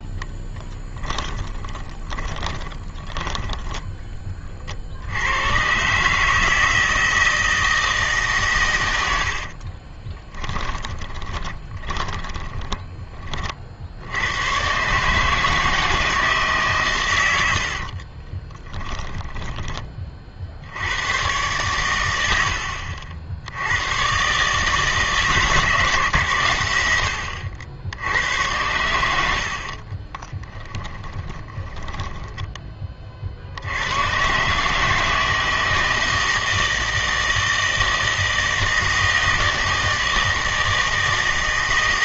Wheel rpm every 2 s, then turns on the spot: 10, 20, 50, 160, 110, 20, 20, 130, 140, 10, 70, 70, 150, 100, 90, 10, 20, 150, 160, 160, 160.
2-4 10-12 18-20 30-32